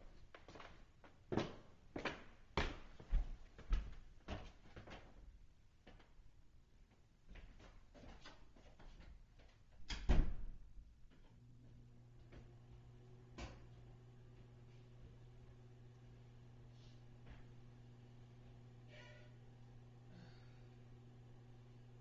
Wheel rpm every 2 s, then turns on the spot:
0, 0, 0, 0, 0, 0, 0, 0, 0, 0, 0.
none